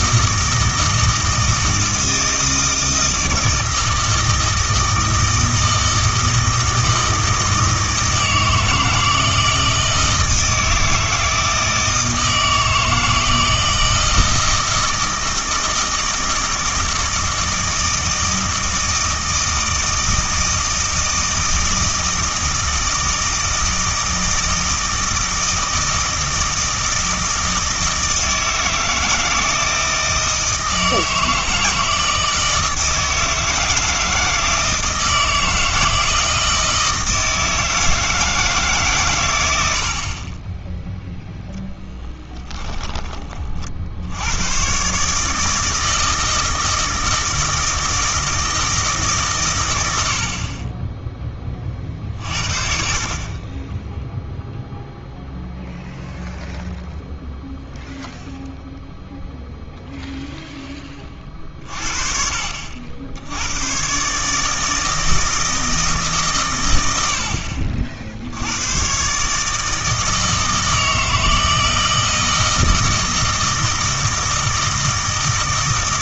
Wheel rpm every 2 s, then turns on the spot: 160, 160, 160, 160, 160, 160, 160, 160, 160, 160, 160, 160, 160, 160, 160, 160, 160, 160, 160, 150, 10, 10, 120, 160, 160, 30, 50, 0, 0, 0, 10, 70, 160, 120, 100, 160, 160, 160.
42-44